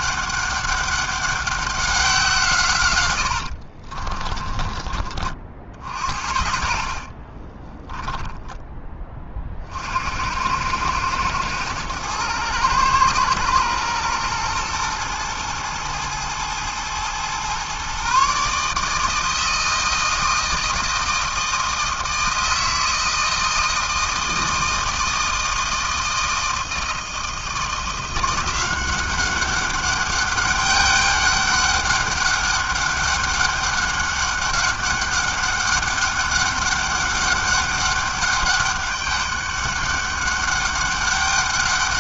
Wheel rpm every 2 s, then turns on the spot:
200, 150, 20, 60, 20, 90, 110, 110, 110, 150, 160, 160, 160, 160, 180, 200, 200, 200, 200, 200, 200.
4-10